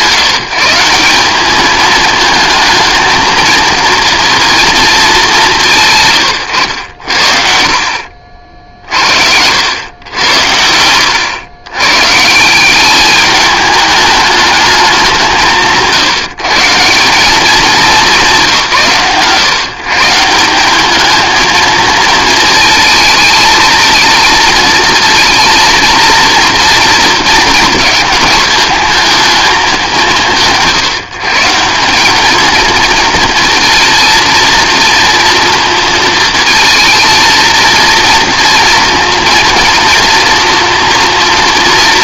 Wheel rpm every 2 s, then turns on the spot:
170, 230, 200, 80, 60, 80, 200, 160, 160, 150, 210, 220, 230, 230, 220, 140, 230, 230, 230, 230, 230.
none